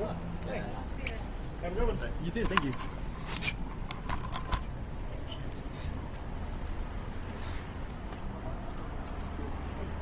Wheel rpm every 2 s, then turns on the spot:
0, 0, 0, 0, 0.
none